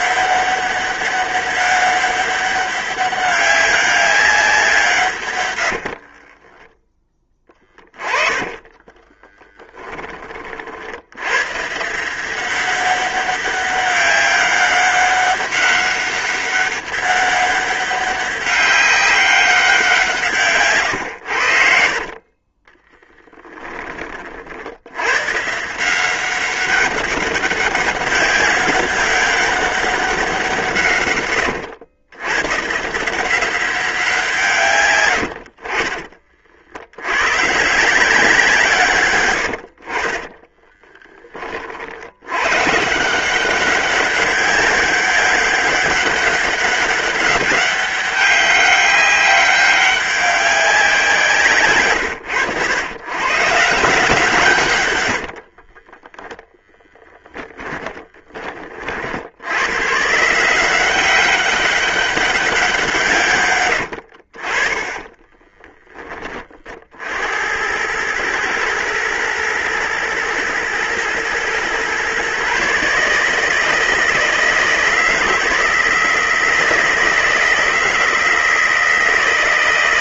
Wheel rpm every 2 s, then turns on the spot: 200, 200, 150, 10, 20, 70, 200, 200, 200, 200, 120, 10, 100, 200, 190, 130, 170, 100, 90, 140, 20, 160, 200, 200, 200, 180, 110, 90, 10, 50, 190, 180, 40, 60, 110, 120, 150, 160, 160, 160.
6-10 20-24 34-36 40-42 54-56 64-66